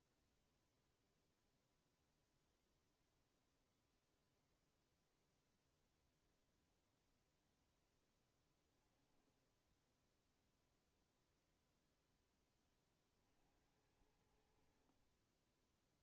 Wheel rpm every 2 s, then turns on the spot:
0, 0, 0, 0, 10, 0, 10, 80.
none